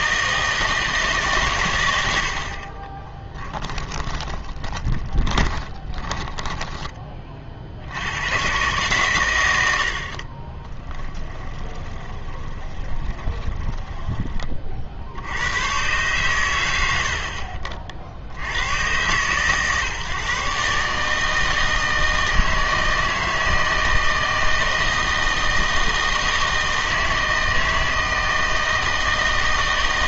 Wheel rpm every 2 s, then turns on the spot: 160, 40, 20, 10, 130, 20, 20, 50, 90, 110, 140, 160, 160, 160, 160.
2-8 10-14